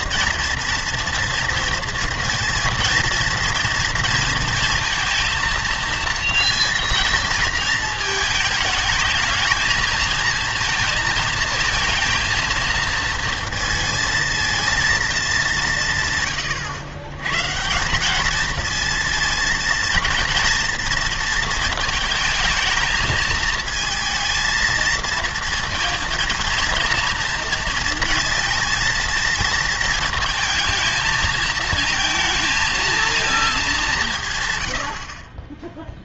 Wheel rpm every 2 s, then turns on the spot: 230, 230, 230, 230, 220, 230, 230, 230, 120, 220, 230, 220, 220, 230, 230, 220, 230, 110.
16-18